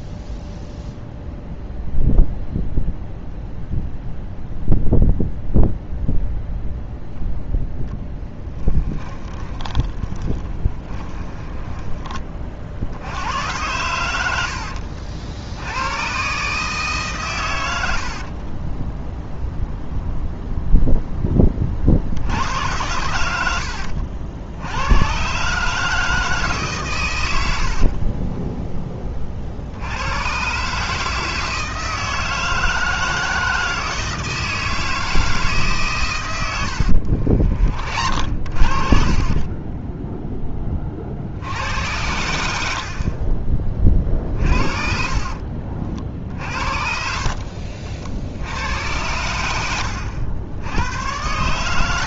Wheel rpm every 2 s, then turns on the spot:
0, 0, 0, 0, 10, 30, 70, 60, 150, 10, 0, 90, 100, 110, 10, 150, 160, 160, 70, 40, 30, 20, 40, 50, 90, 110.
8-12 18-20 36-38 44-48